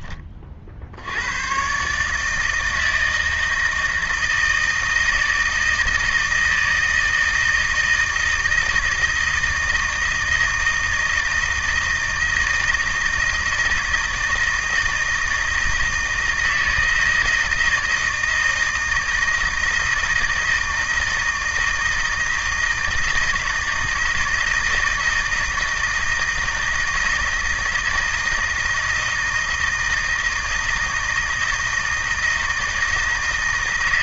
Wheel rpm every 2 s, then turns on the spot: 50, 160, 160, 160, 160, 160, 160, 160, 160, 160, 160, 160, 160, 160, 160, 160, 160.
none